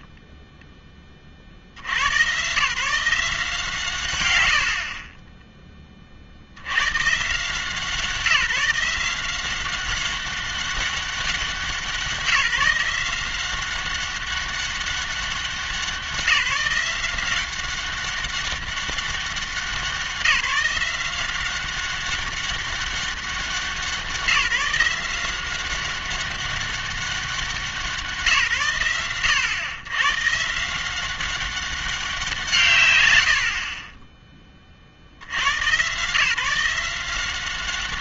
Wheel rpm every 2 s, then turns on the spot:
10, 120, 80, 90, 170, 200, 170, 200, 170, 200, 170, 200, 170, 200, 130, 160, 140, 40, 160.
none